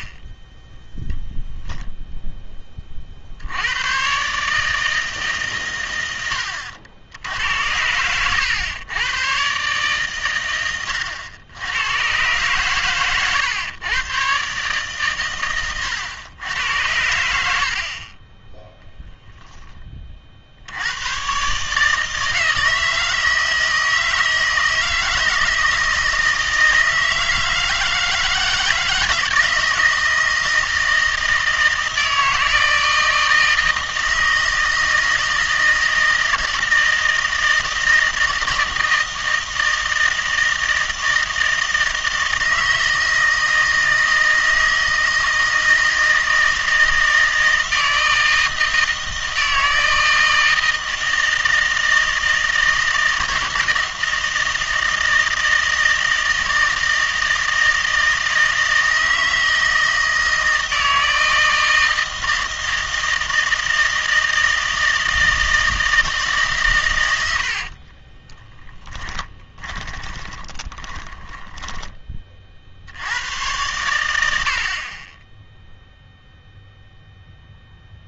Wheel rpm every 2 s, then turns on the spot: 0, 30, 160, 80, 110, 100, 110, 130, 100, 10, 90, 160, 160, 160, 160, 160, 160, 160, 160, 160, 160, 160, 160, 160, 160, 160, 160, 160, 160, 160, 160, 160, 160, 120, 10, 20, 70, 40, 0.
68-72